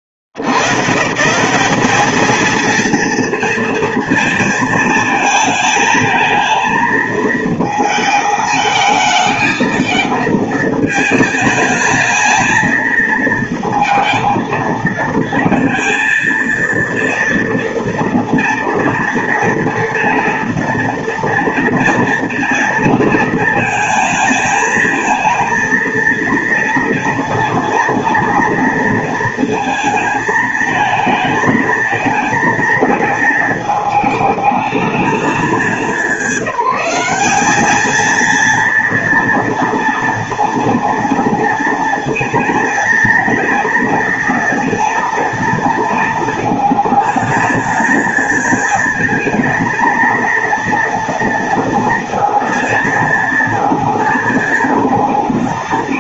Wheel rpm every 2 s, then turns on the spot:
80, 220, 230, 220, 220, 220, 220, 220, 230, 230, 230, 230, 220, 230, 230, 220, 220, 220, 210, 230, 230, 220, 230, 230, 220, 230, 230, 230.
none